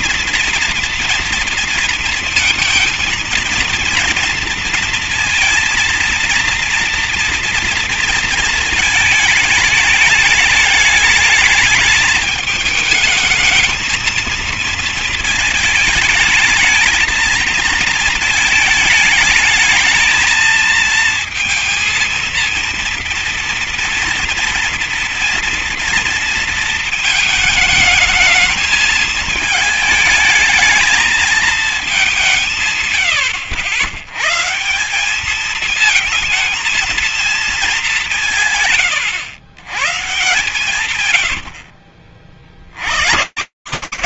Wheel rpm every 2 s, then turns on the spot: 230, 230, 230, 230, 230, 210, 220, 220, 220, 220, 220, 230, 230, 230, 220, 220, 180, 110, 220, 160, 130, 50.
none